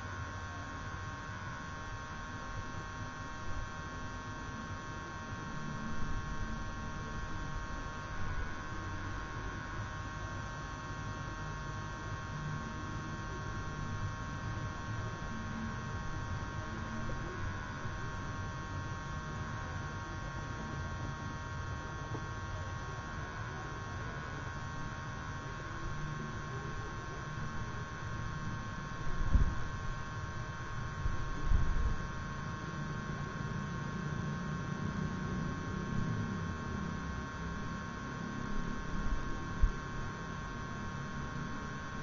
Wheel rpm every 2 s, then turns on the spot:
0, 0, 0, 0, 0, 0, 0, 0, 0, 0, 0, 0, 0, 0, 0, 0, 0, 0, 0, 0, 0.
none